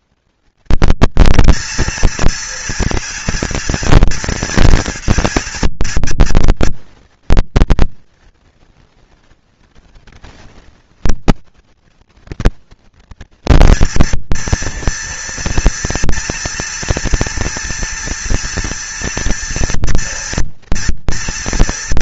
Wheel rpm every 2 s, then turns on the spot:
210, 230, 230, 230, 230, 230, 230, 230, 230, 230, 230.
none